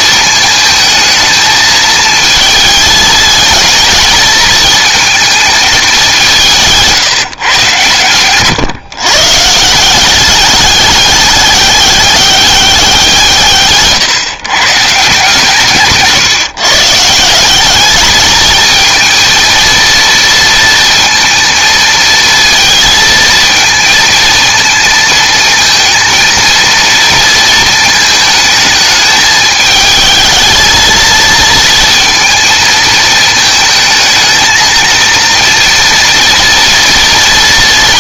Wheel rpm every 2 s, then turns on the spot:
220, 220, 220, 170, 120, 210, 200, 130, 140, 220, 230, 220, 230, 230, 220, 220, 220, 230, 230.
none